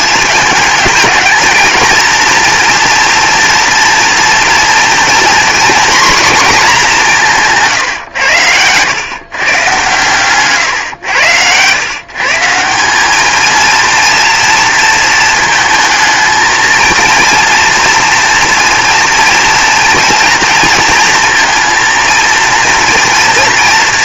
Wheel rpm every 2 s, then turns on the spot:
210, 230, 230, 220, 120, 120, 190, 230, 230, 230, 220, 230.
none